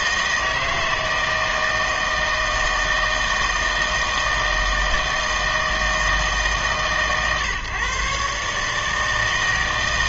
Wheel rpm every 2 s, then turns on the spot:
160, 160, 160, 150, 150.
none